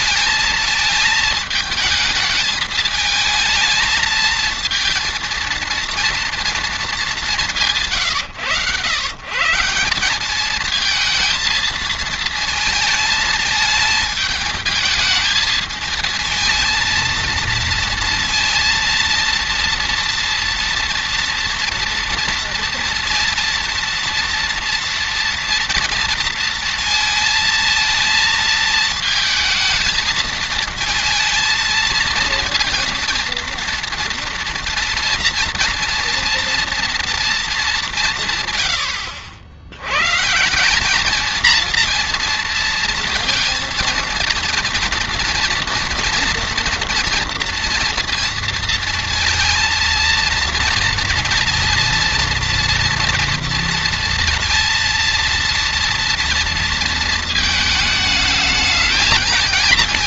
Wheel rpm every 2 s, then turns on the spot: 220, 220, 230, 230, 110, 210, 230, 220, 230, 230, 230, 230, 230, 230, 220, 220, 230, 230, 230, 140, 170, 230, 230, 240, 230, 230, 230, 230, 230, 220.
none